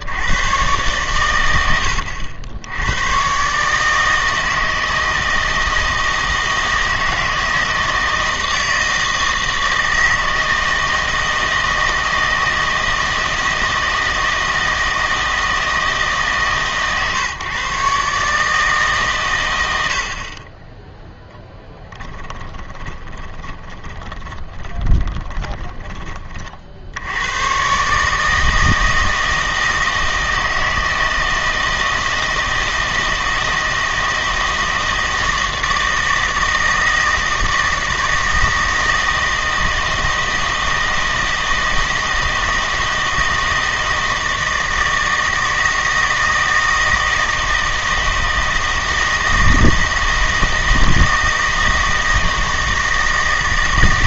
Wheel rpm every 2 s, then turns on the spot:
120, 90, 160, 160, 160, 160, 160, 160, 140, 150, 20, 20, 10, 50, 160, 160, 160, 160, 160, 160, 160, 160, 160, 160, 160, 160, 160.
22-26